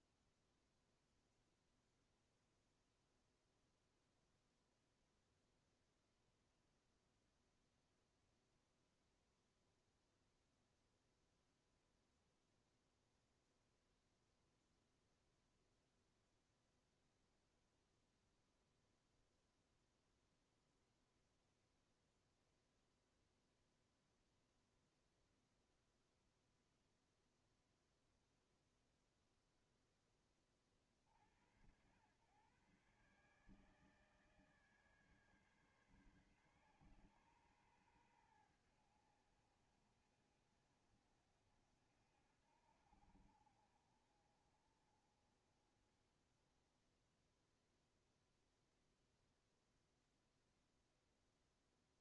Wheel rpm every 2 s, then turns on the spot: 0, 0, 0, 0, 0, 0, 0, 0, 0, 0, 0, 0, 0, 0, 0, 20, 110, 150, 130, 100, 50, 60, 40, 10, 0, 0.
none